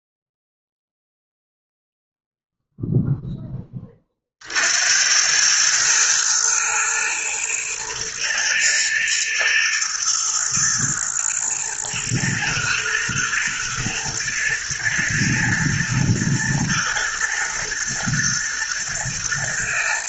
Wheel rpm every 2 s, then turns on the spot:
0, 0, 60, 110, 110, 120, 110, 110, 110, 110.
none